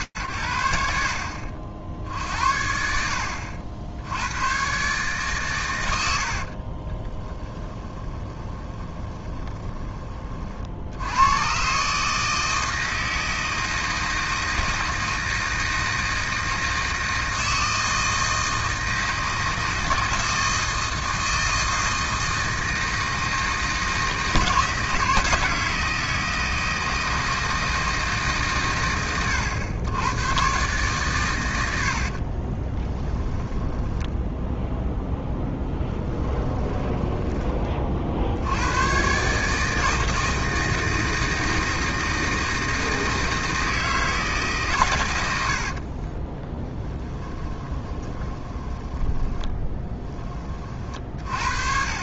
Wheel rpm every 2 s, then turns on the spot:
60, 60, 100, 20, 20, 130, 160, 160, 160, 160, 160, 160, 160, 160, 100, 120, 10, 0, 10, 120, 160, 160, 120, 10, 10, 40.
6-10 32-34 36-38 46-50